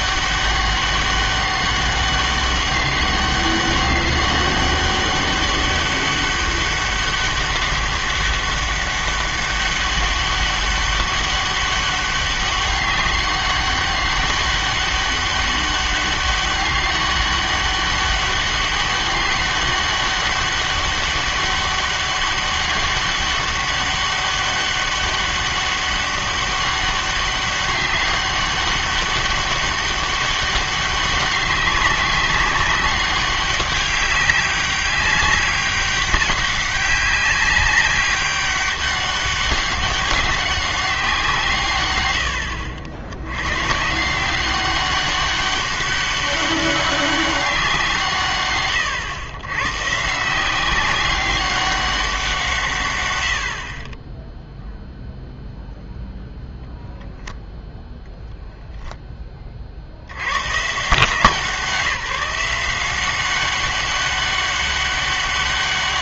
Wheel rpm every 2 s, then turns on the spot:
200, 200, 190, 200, 200, 200, 200, 200, 200, 200, 200, 200, 200, 200, 200, 190, 200, 200, 190, 200, 190, 80, 190, 200, 120, 180, 150, 0, 0, 0, 120, 170, 200.
42-44